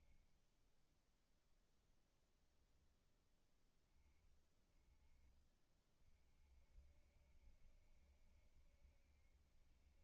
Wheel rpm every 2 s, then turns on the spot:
10, 30, 60, 60, 30.
none